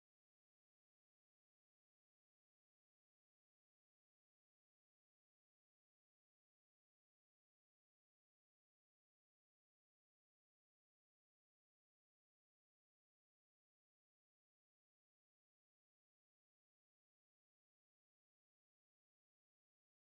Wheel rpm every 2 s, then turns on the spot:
0, 0, 0, 0, 0, 0, 0, 0, 0, 0.
none